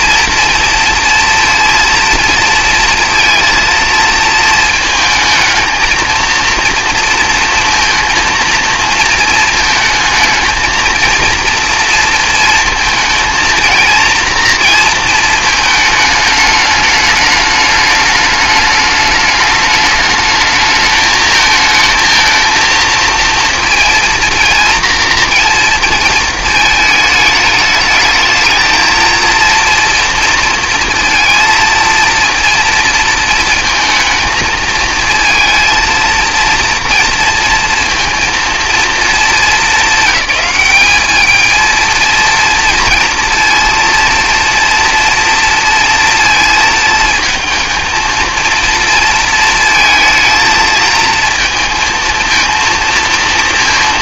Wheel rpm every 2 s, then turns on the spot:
230, 230, 220, 230, 230, 230, 230, 230, 210, 210, 220, 230, 240, 220, 230, 230, 230, 220, 240, 230, 210, 230, 230, 220, 230, 230, 230.
none